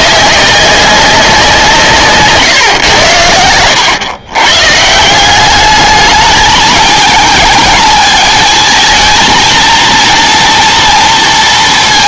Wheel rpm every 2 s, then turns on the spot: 190, 120, 150, 220, 230, 230.
none